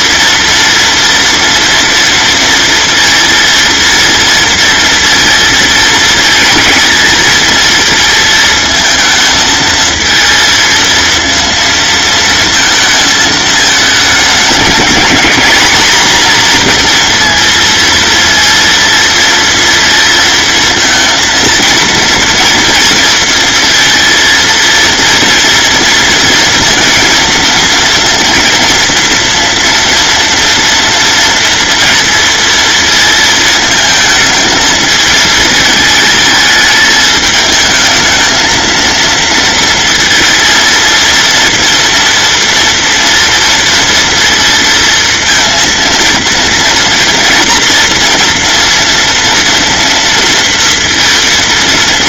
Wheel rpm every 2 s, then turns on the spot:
230, 230, 230, 220, 220, 230, 220, 210, 240, 230, 230, 230, 230, 230, 230, 230, 230, 220, 220, 230, 230, 230, 230, 230, 240, 230.
none